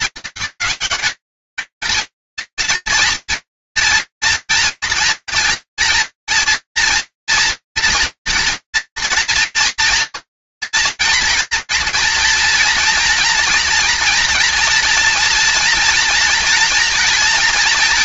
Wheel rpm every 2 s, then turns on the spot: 210, 230, 230, 230, 230, 230, 230, 230, 230.
none